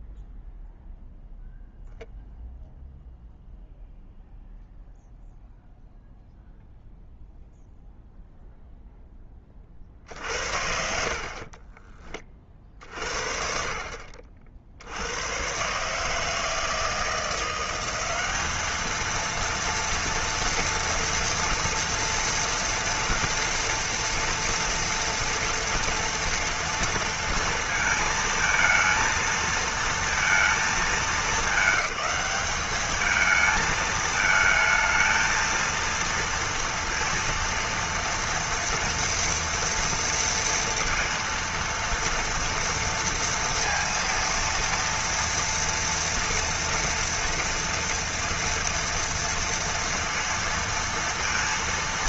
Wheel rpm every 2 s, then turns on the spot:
0, 0, 0, 0, 0, 60, 30, 60, 160, 200, 230, 230, 230, 230, 220, 220, 200, 220, 230, 230, 230, 230, 230, 230, 230, 230.
none